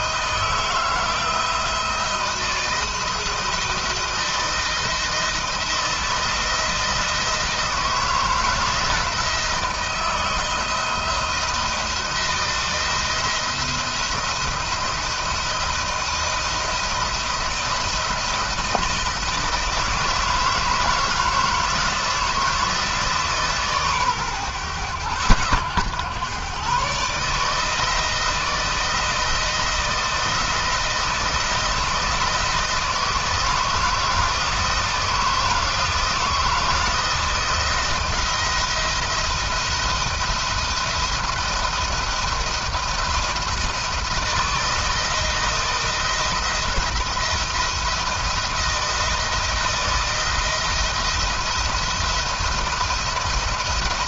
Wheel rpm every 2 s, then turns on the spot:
160, 160, 160, 170, 170, 170, 170, 160, 160, 170, 160, 160, 110, 140, 160, 170, 160, 160, 160, 170, 170, 170, 160, 170, 160, 170, 170.
none